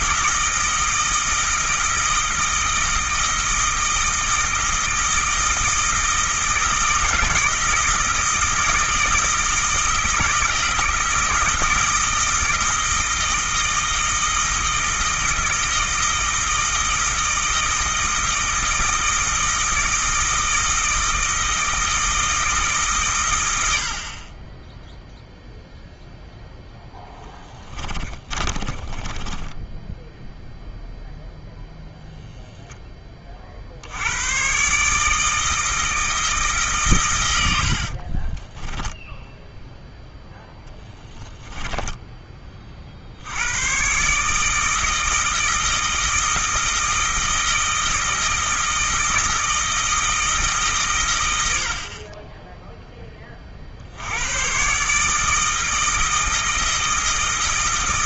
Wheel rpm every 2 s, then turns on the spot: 160, 160, 160, 160, 160, 160, 160, 160, 160, 160, 160, 150, 10, 0, 20, 0, 10, 140, 130, 10, 10, 40, 160, 160, 160, 130, 10, 130, 160.
28-30 38-42